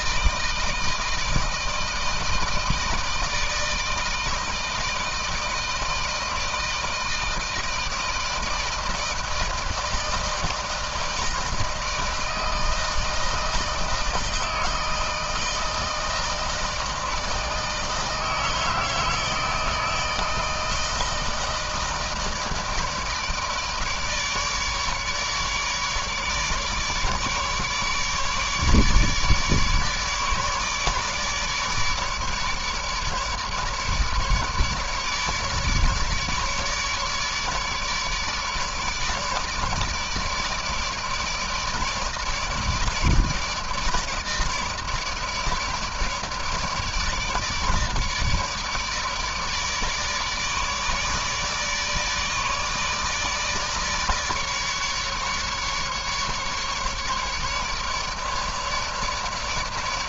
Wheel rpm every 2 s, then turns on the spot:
160, 160, 160, 160, 160, 160, 160, 160, 160, 160, 160, 160, 150, 150, 150, 150, 150, 150, 150, 150, 150, 150, 160, 150, 150, 150, 150, 150, 150, 150.
none